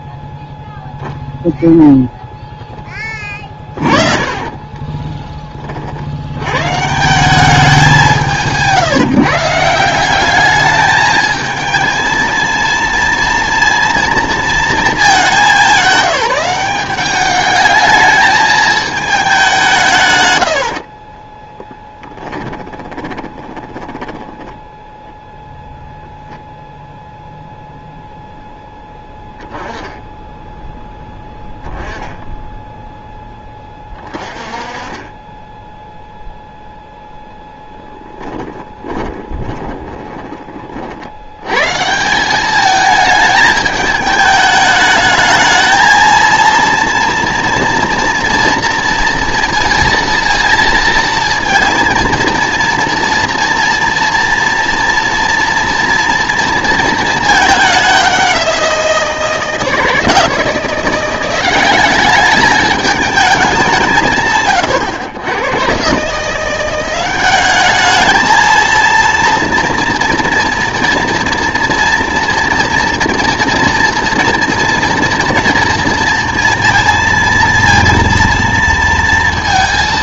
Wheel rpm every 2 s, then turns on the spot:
0, 20, 20, 150, 150, 210, 230, 220, 190, 220, 60, 10, 0, 0, 10, 10, 0, 30, 0, 20, 50, 210, 210, 230, 230, 230, 230, 230, 230, 180, 170, 210, 120, 180, 230, 230, 230, 230, 230, 230.
4-6 20-24 38-40